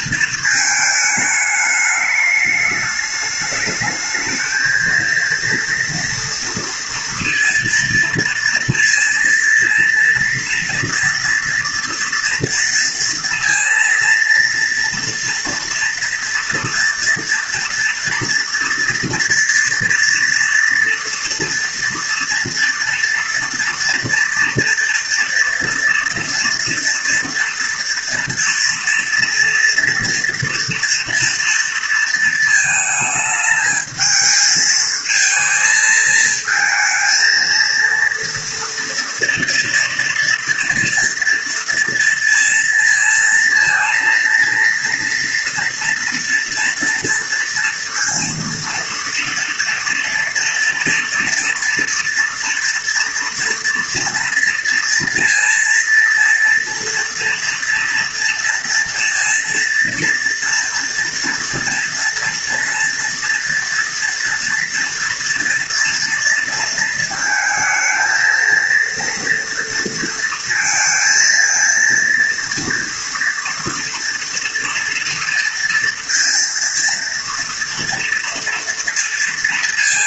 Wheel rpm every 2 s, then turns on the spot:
220, 210, 220, 230, 230, 230, 230, 230, 230, 230, 230, 230, 230, 230, 230, 240, 220, 220, 220, 230, 230, 230, 230, 240, 230, 230, 240, 230, 230, 230, 230, 230, 230, 230, 230, 220, 230, 230, 230, 230.
none